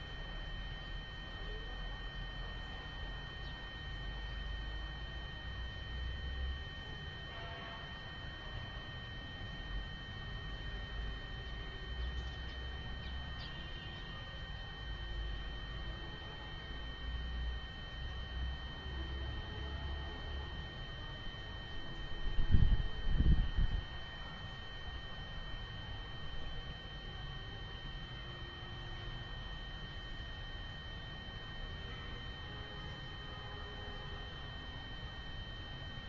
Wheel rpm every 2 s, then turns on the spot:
0, 0, 0, 0, 0, 0, 0, 0, 0, 0, 0, 0, 0, 0, 0, 0, 0, 0.
none